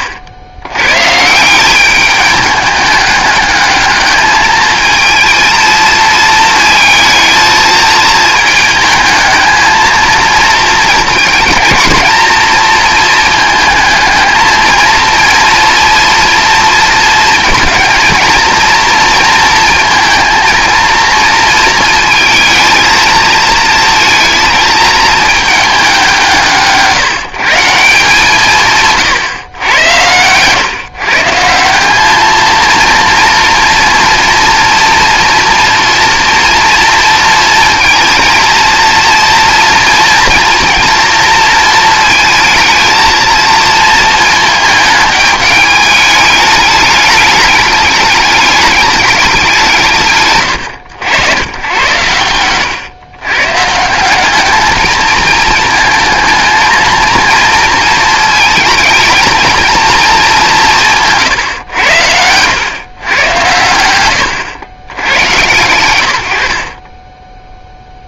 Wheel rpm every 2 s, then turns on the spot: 120, 210, 220, 220, 220, 230, 230, 220, 230, 230, 230, 220, 220, 150, 150, 140, 230, 230, 230, 230, 230, 220, 220, 210, 210, 110, 110, 220, 230, 220, 170, 110, 90, 40.
none